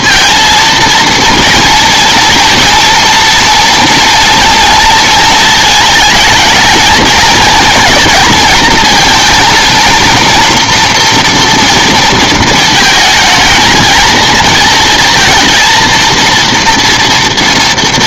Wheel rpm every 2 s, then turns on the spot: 230, 230, 230, 220, 230, 230, 220, 230, 230.
none